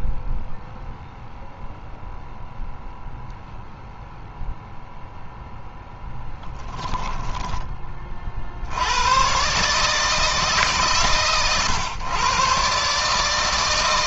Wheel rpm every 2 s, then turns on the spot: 0, 0, 0, 10, 90, 150, 140.
6-8